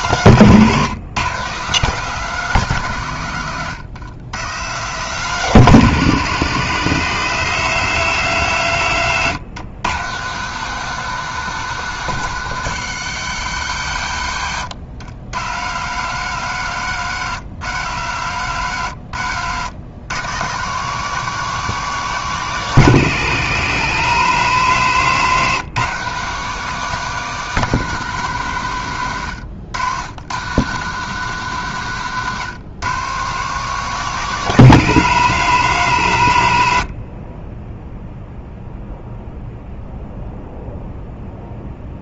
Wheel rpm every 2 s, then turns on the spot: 130, 160, 120, 140, 130, 160, 160, 90, 150, 130, 140, 160, 150, 170, 150, 130, 130, 160, 90, 0, 0.
none